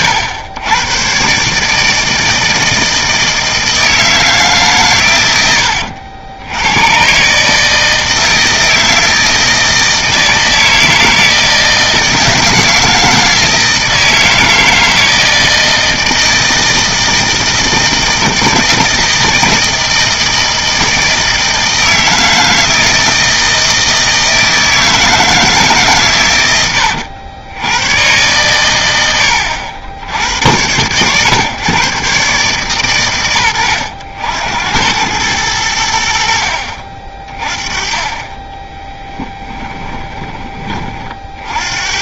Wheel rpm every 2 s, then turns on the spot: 110, 160, 140, 100, 160, 160, 160, 160, 160, 160, 160, 160, 160, 100, 110, 100, 130, 90, 60, 20, 20.
38-40